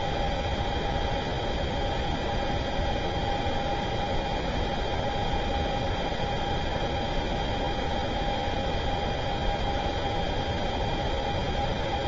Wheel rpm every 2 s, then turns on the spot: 0, 0, 0, 0, 0, 0.
none